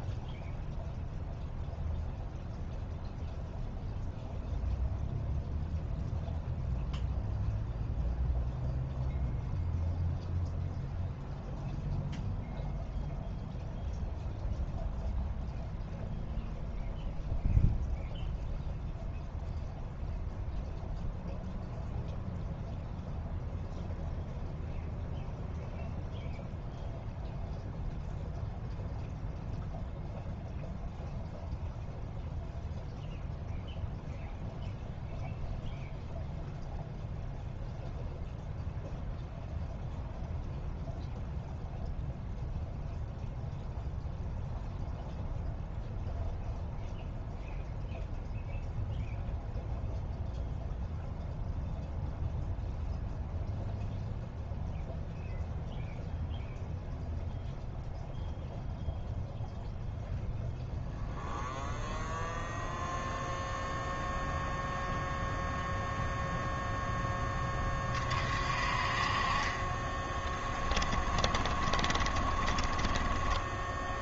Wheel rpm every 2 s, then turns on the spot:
0, 0, 0, 0, 0, 0, 0, 0, 0, 0, 0, 0, 0, 0, 0, 0, 0, 0, 0, 0, 0, 0, 0, 0, 0, 0, 0, 0, 0, 0, 0, 0, 0, 0, 40, 10, 20.
70-74